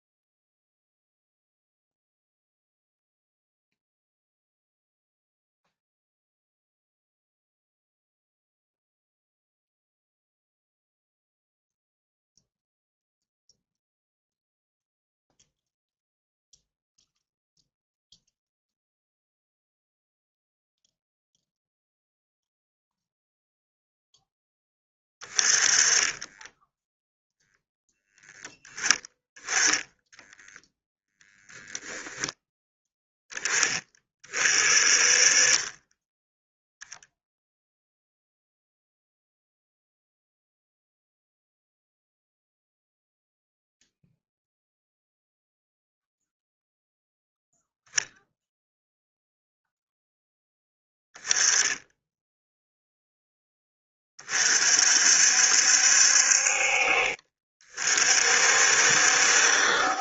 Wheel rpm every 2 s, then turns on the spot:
0, 0, 0, 0, 0, 0, 0, 0, 0, 0, 0, 0, 20, 0, 10, 10, 10, 30, 0, 0, 0, 0, 0, 0, 0, 10, 0, 50, 50, 60.
none